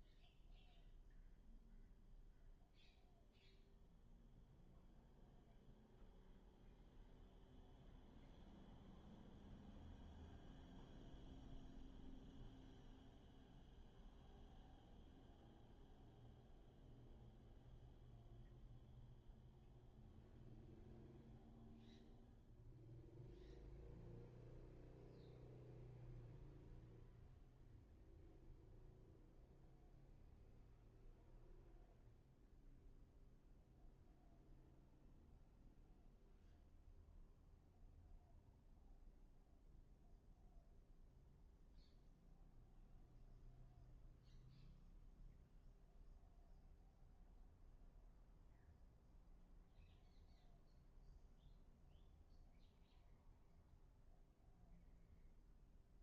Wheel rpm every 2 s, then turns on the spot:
0, 0, 0, 0, 0, 0, 0, 0, 0, 0, 0, 0, 0, 0, 0, 0, 0, 0, 0, 0, 0, 0, 0, 0, 0, 0, 0, 0.
none